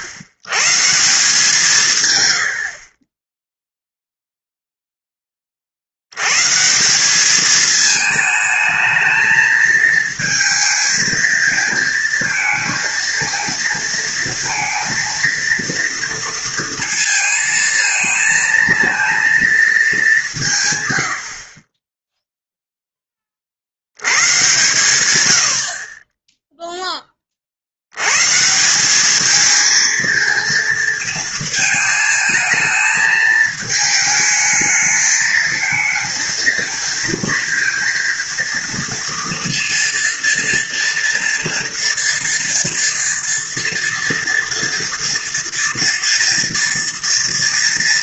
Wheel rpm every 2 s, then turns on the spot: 130, 70, 0, 140, 220, 220, 230, 230, 230, 230, 150, 0, 120, 10, 160, 230, 220, 220, 230, 230, 230, 230, 240, 230.
none